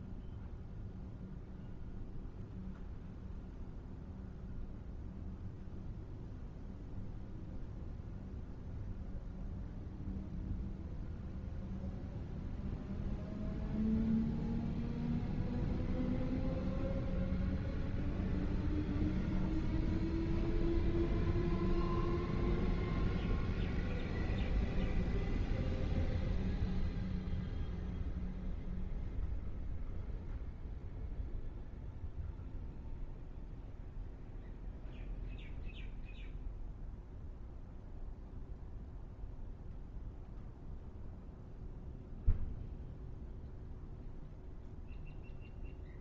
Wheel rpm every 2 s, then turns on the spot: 0, 0, 0, 0, 0, 0, 0, 0, 0, 0, 0, 0, 0, 0, 0, 0, 0, 0, 0, 0, 0, 0, 0.
none